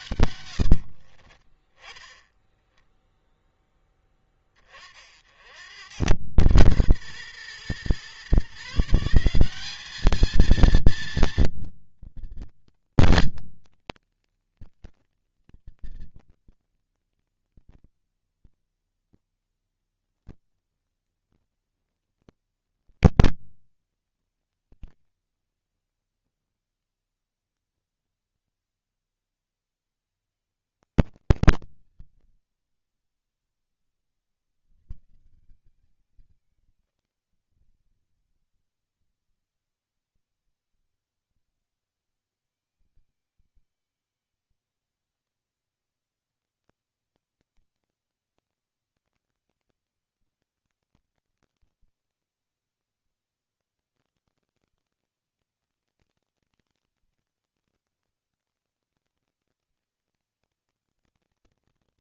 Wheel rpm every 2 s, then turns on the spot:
90, 0, 30, 120, 150, 230, 230, 230, 230, 230, 230, 230, 230, 90, 40, 170, 40, 90, 150, 140, 170, 190, 190, 160, 160, 160, 160, 160, 160, 160, 160.
0-2 26-30